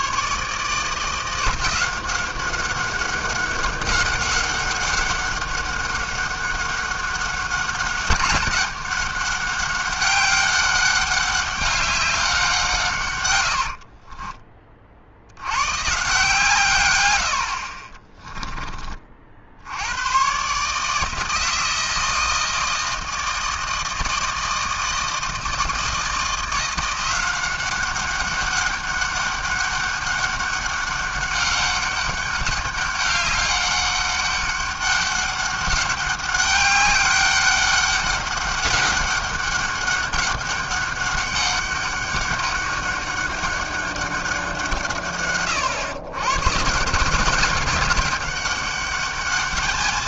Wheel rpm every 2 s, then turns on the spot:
150, 190, 200, 200, 200, 200, 170, 40, 140, 20, 140, 160, 160, 170, 200, 200, 200, 200, 200, 200, 200, 200, 180, 140, 200.
none